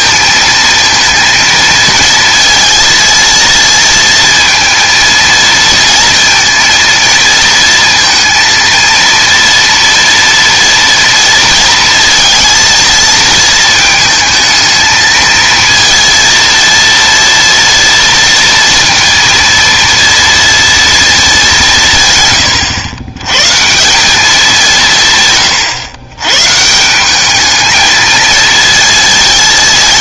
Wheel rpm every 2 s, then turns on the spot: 220, 230, 230, 230, 230, 230, 220, 220, 230, 230, 230, 100, 150, 160, 230.
none